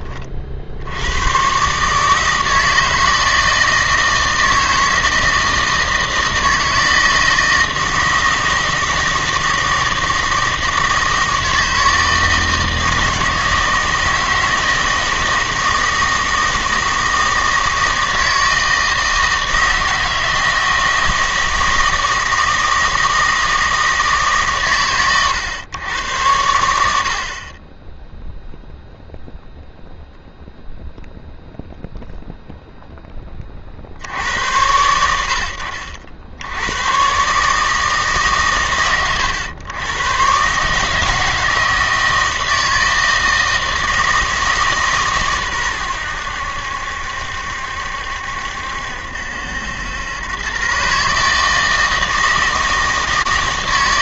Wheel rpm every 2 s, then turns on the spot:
60, 160, 160, 160, 160, 160, 160, 160, 160, 160, 160, 160, 130, 80, 0, 0, 0, 80, 100, 120, 140, 160, 150, 80, 70, 130, 160.
none